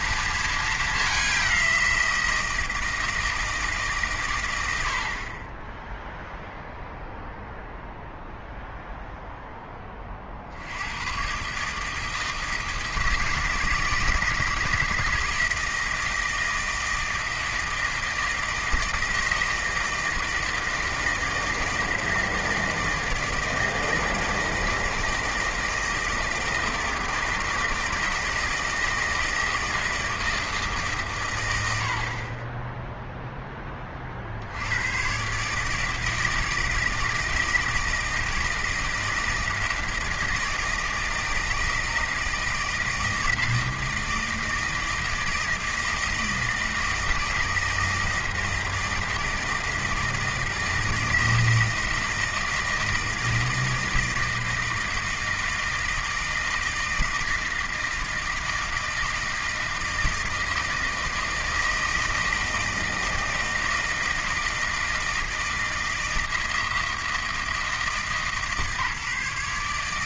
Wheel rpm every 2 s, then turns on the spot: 210, 160, 80, 0, 0, 80, 160, 160, 160, 160, 160, 160, 160, 160, 160, 150, 10, 80, 160, 160, 160, 160, 160, 160, 160, 160, 160, 160, 160, 160, 160, 160, 160, 160, 150.
none